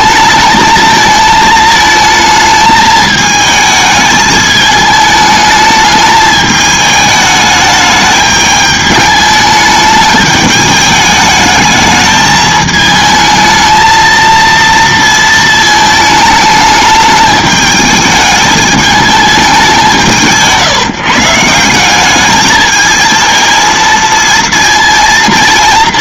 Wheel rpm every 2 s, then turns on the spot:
220, 220, 210, 210, 210, 210, 220, 230, 210, 210, 150, 220, 230.
none